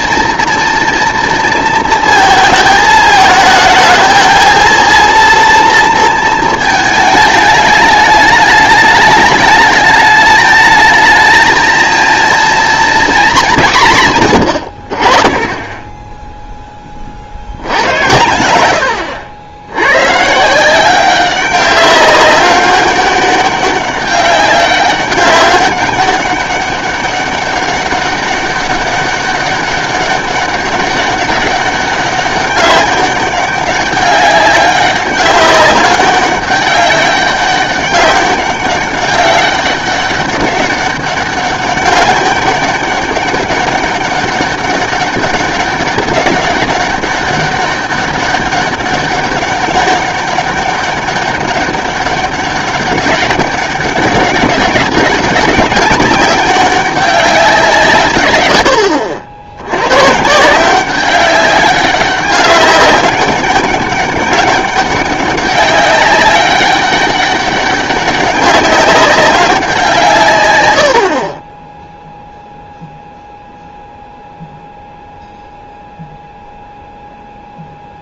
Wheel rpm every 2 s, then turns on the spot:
240, 220, 220, 220, 210, 210, 230, 110, 10, 100, 170, 200, 200, 200, 200, 200, 190, 200, 200, 200, 200, 200, 200, 190, 200, 190, 200, 200, 200, 90, 170, 200, 190, 200, 200, 110, 0, 0, 0.
none